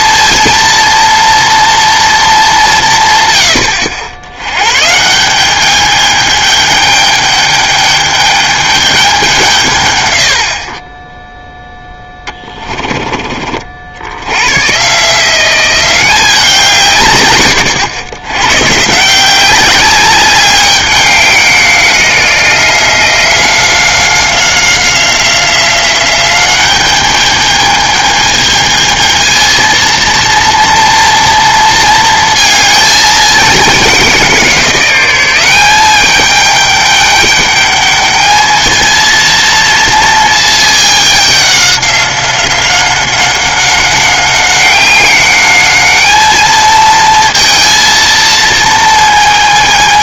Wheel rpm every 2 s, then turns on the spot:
230, 190, 110, 210, 210, 60, 20, 120, 170, 120, 200, 180, 180, 190, 220, 230, 220, 180, 210, 220, 220, 190, 190, 220, 230.
12-14